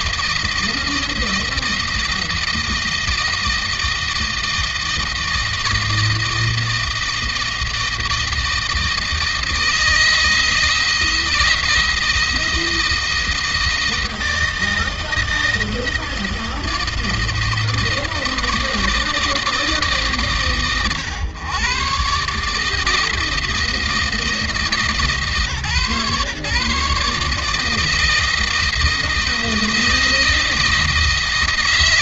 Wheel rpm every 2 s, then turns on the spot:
160, 160, 160, 160, 160, 160, 170, 160, 160, 160, 130, 150, 160, 150, 160, 160.
none